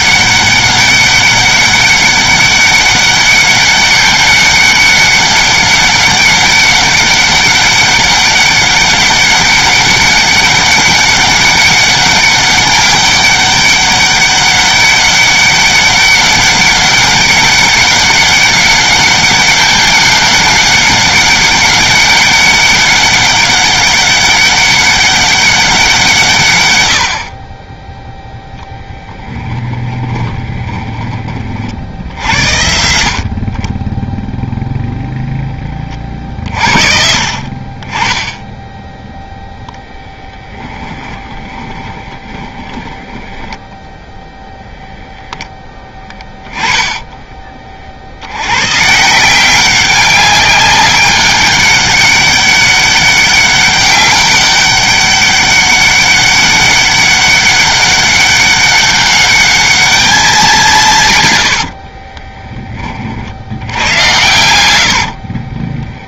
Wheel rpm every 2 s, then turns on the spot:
200, 200, 200, 200, 200, 200, 200, 200, 200, 200, 200, 200, 200, 90, 0, 20, 70, 0, 50, 0, 20, 20, 0, 10, 140, 200, 200, 200, 200, 200, 160, 30, 100.
40-44 46-48 64-66